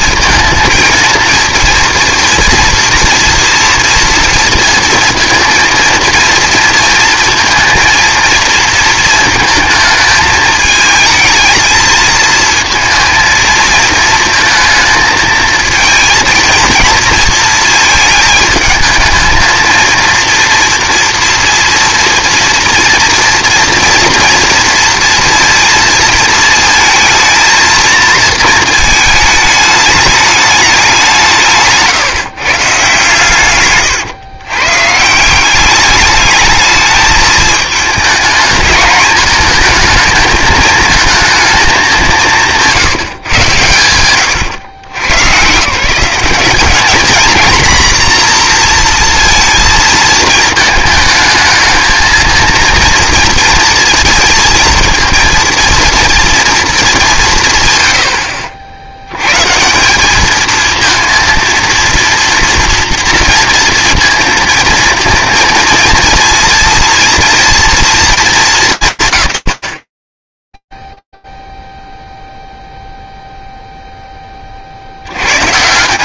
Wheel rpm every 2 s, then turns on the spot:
220, 230, 230, 230, 230, 220, 230, 220, 230, 220, 230, 230, 230, 220, 220, 170, 130, 160, 220, 220, 220, 150, 110, 210, 230, 220, 230, 230, 190, 80, 230, 230, 230, 240, 190, 0, 0, 30.
none